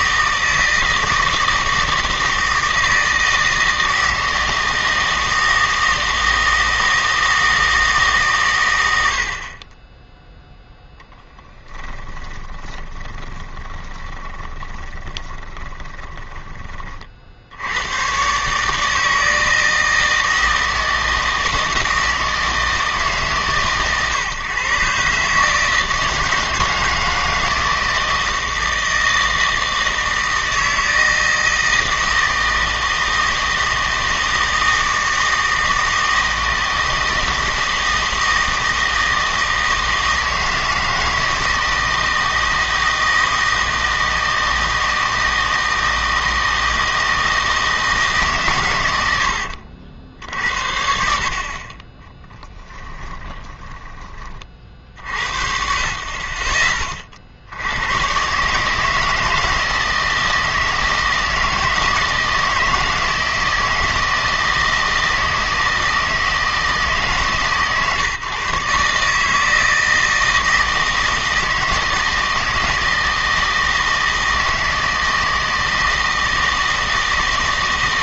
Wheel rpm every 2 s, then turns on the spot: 160, 160, 160, 160, 100, 0, 20, 20, 30, 150, 160, 160, 130, 160, 160, 160, 160, 160, 160, 160, 160, 160, 160, 160, 110, 60, 10, 40, 30, 150, 160, 160, 160, 160, 140, 160, 160, 160, 160.
12-16 52-54